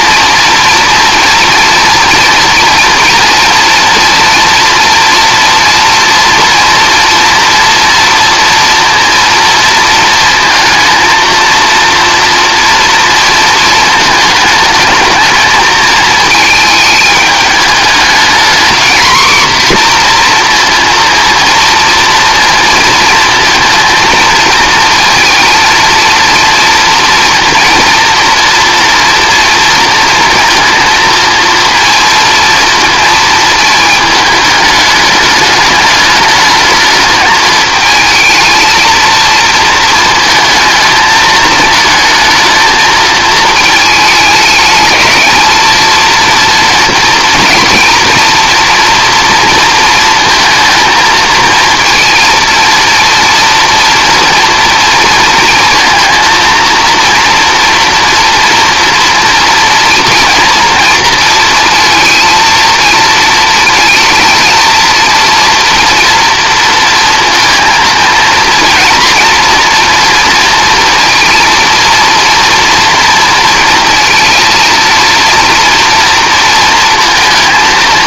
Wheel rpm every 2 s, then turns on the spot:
240, 230, 230, 230, 240, 230, 230, 220, 220, 240, 230, 230, 230, 230, 230, 230, 230, 210, 220, 220, 220, 220, 210, 230, 240, 230, 230, 230, 230, 230, 240, 230, 220, 230, 230, 230, 230, 230, 230.
none